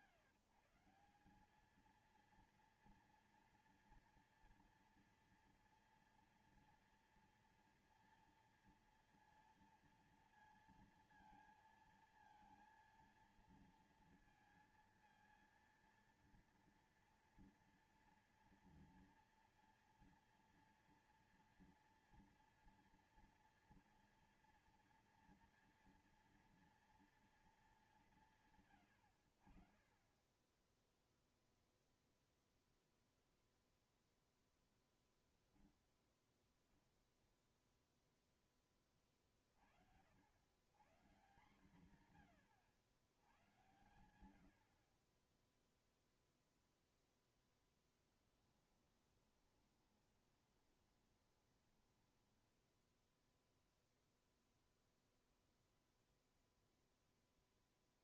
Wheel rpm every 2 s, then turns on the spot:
160, 230, 230, 230, 230, 230, 230, 230, 230, 230, 230, 240, 230, 230, 160, 20, 0, 0, 0, 10, 110, 110, 80, 0, 10, 20, 10, 0, 0.
48-54